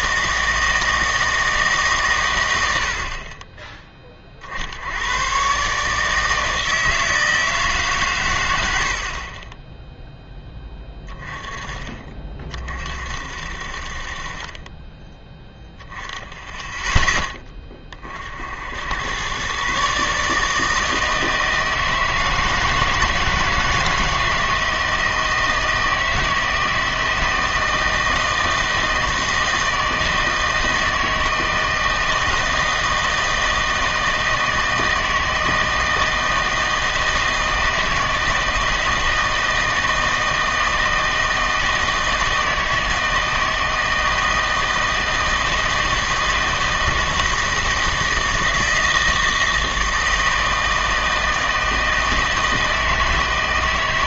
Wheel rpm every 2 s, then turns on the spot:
160, 90, 60, 160, 100, 10, 40, 30, 10, 70, 150, 160, 160, 160, 160, 160, 160, 160, 160, 160, 160, 160, 160, 160, 160, 160, 160.
none